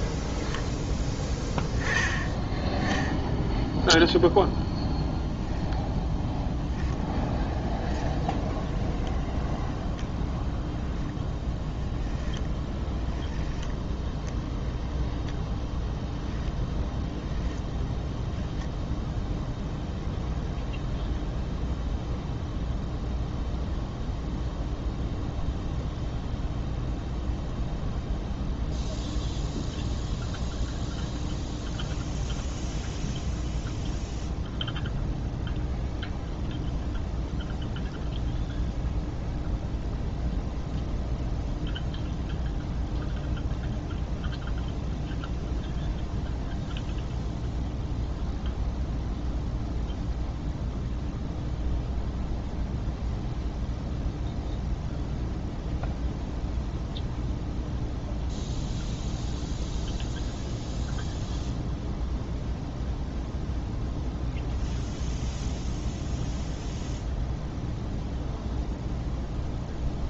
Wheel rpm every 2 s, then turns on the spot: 0, 10, 0, 0, 0, 0, 10, 0, 10, 0, 0, 0, 0, 0, 0, 0, 0, 0, 0, 0, 0, 0, 0, 0, 0, 0, 0, 0, 0, 0, 0, 0, 0, 0, 0.
12-14